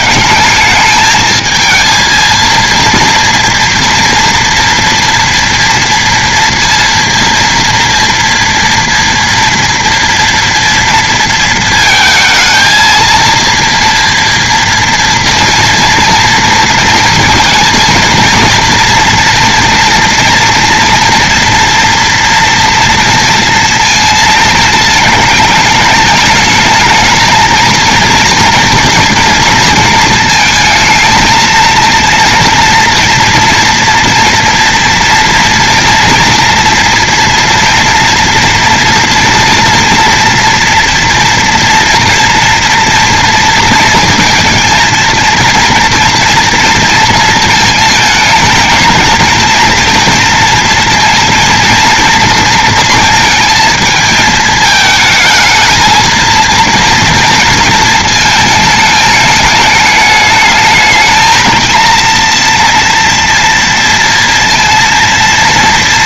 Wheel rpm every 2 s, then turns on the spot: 200, 230, 230, 230, 230, 230, 230, 230, 230, 230, 230, 230, 220, 220, 230, 220, 230, 230, 240, 230, 230, 230, 230, 230, 220, 230, 230, 220, 230, 220, 220, 240, 230.
none